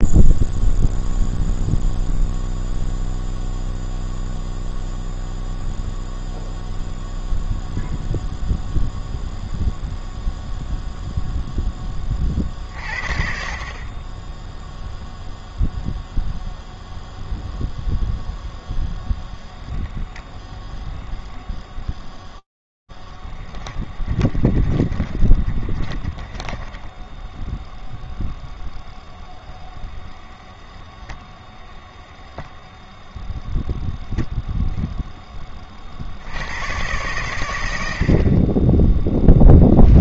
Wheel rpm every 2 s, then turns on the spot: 0, 0, 0, 0, 0, 0, 40, 0, 0, 10, 0, 20, 30, 20, 0, 0, 0, 10, 100, 10.
22-28